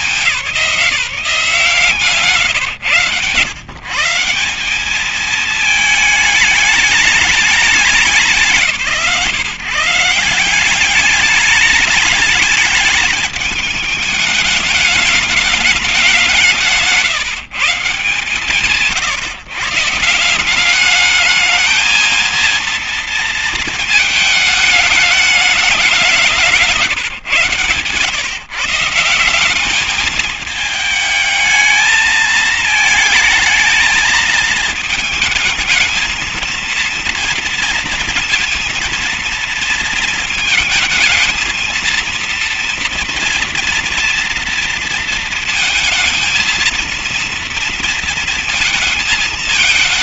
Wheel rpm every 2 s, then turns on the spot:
160, 140, 220, 190, 150, 210, 210, 200, 160, 150, 220, 220, 190, 110, 200, 220, 220, 220, 230, 230, 230, 230, 230, 230, 220.
0-2